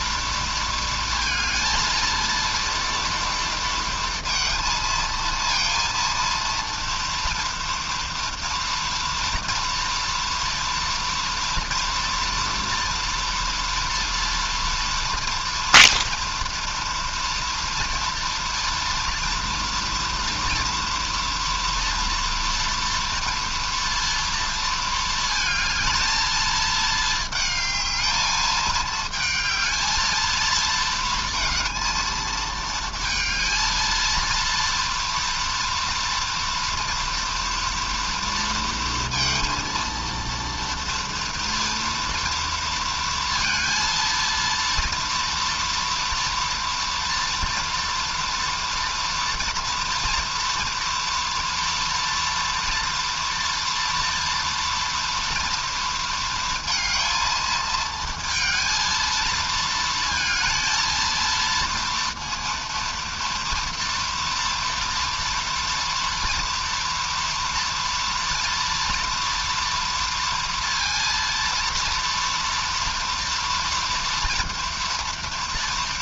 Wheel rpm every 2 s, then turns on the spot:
230, 230, 230, 230, 230, 230, 230, 230, 230, 230, 230, 230, 230, 220, 220, 220, 220, 230, 230, 230, 230, 230, 230, 230, 240, 230, 230, 230, 220, 230, 230, 230, 230, 240, 230, 230, 230, 230.
none